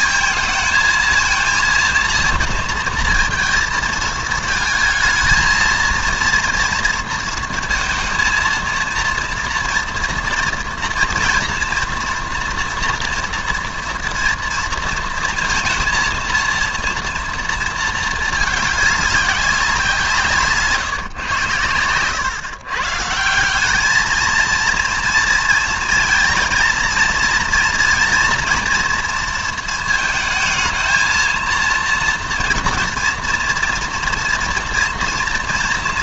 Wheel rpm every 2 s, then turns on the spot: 220, 230, 220, 230, 230, 230, 230, 230, 230, 210, 150, 140, 230, 230, 230, 220, 230, 230.
none